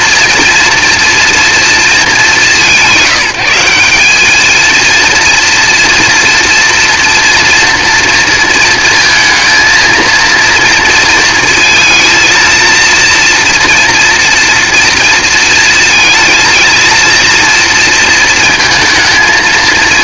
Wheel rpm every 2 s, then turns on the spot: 230, 160, 230, 230, 230, 230, 230, 230, 230, 220.
none